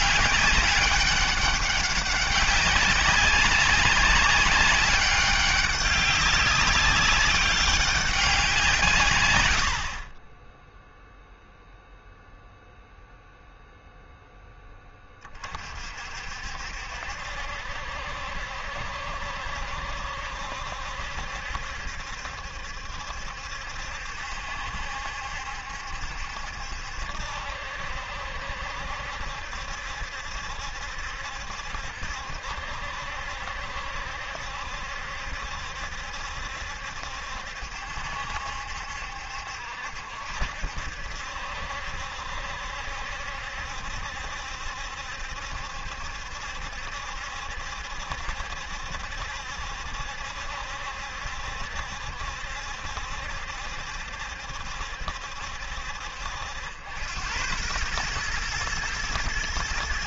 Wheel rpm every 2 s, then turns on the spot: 200, 200, 200, 200, 160, 10, 0, 10, 60, 70, 70, 70, 70, 70, 70, 70, 70, 70, 70, 70, 70, 70, 70, 70, 70, 70, 70, 70, 80, 120.
none